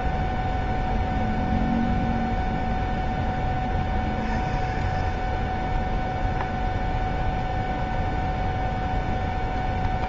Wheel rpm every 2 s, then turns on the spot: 0, 0, 0, 0, 0.
none